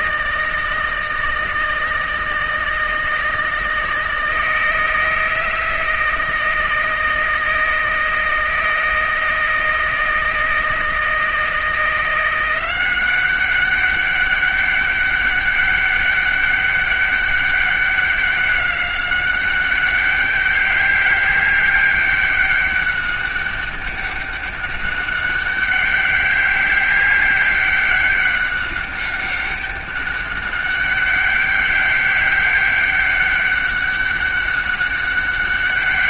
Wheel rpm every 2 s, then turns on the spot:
160, 160, 160, 160, 160, 160, 180, 200, 200, 190, 200, 200, 200, 200, 200, 200, 200, 200.
none